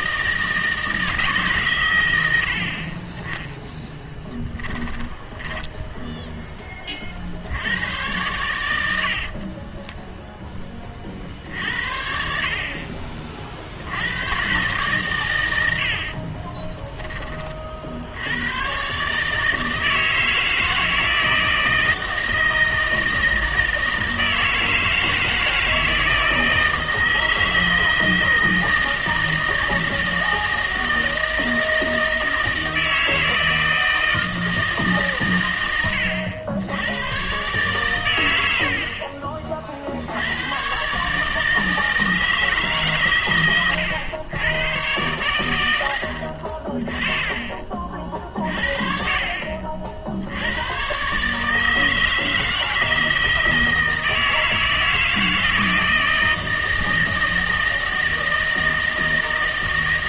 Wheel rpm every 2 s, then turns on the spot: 160, 50, 10, 20, 80, 30, 50, 120, 20, 120, 160, 160, 160, 160, 160, 160, 160, 150, 90, 60, 130, 140, 110, 30, 50, 120, 160, 160, 160, 160.
4-6 8-10 16-18 46-48